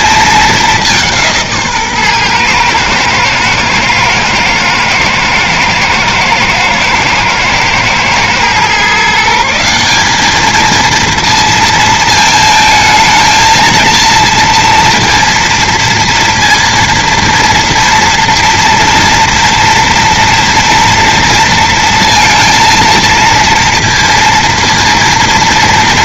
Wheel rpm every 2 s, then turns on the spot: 210, 120, 110, 110, 130, 220, 220, 230, 230, 230, 240, 230, 230.
none